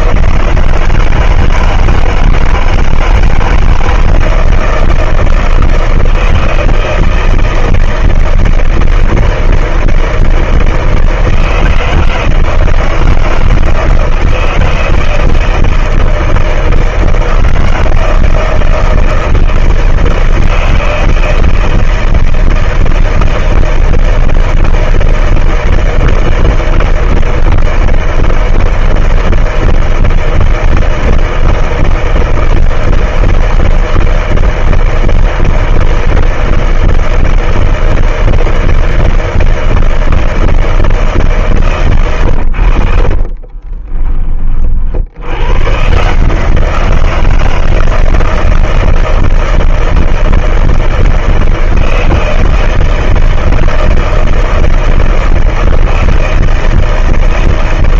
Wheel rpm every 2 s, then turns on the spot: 160, 160, 160, 160, 160, 160, 160, 160, 160, 160, 160, 160, 160, 160, 160, 160, 160, 160, 160, 160, 160, 120, 20, 140, 160, 160, 160, 160, 160.
42-46